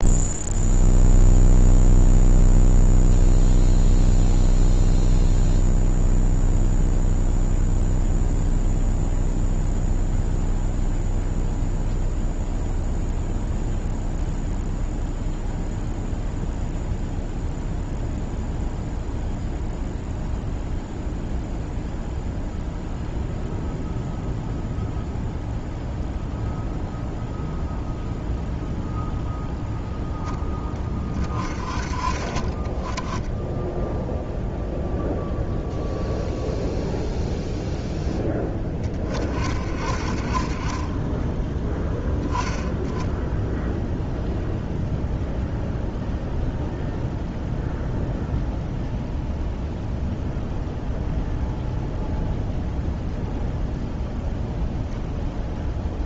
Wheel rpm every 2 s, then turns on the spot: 0, 0, 0, 0, 0, 0, 0, 0, 0, 0, 0, 0, 0, 0, 0, 20, 30, 0, 0, 20, 20, 10, 0, 0, 0, 0, 0, 0.
none